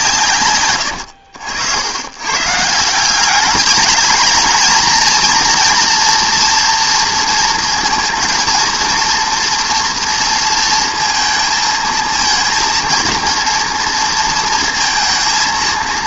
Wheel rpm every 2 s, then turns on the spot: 190, 80, 200, 230, 230, 240, 230, 230.
none